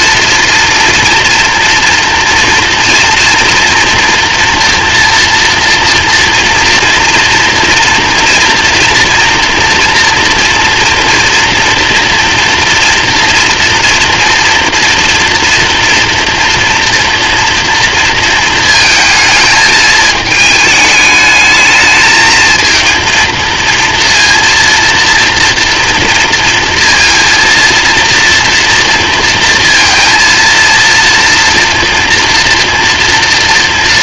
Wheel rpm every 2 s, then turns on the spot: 230, 230, 230, 230, 240, 230, 230, 230, 230, 220, 220, 230, 230, 230, 230, 230, 240.
none